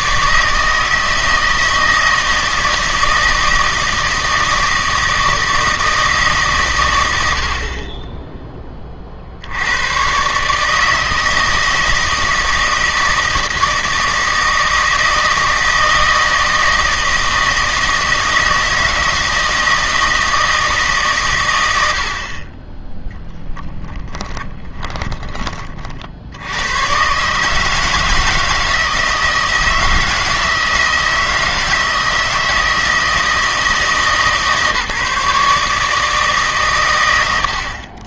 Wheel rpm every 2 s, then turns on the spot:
160, 160, 160, 120, 20, 150, 160, 160, 160, 160, 160, 20, 30, 100, 160, 160, 160, 150, 120.
24-26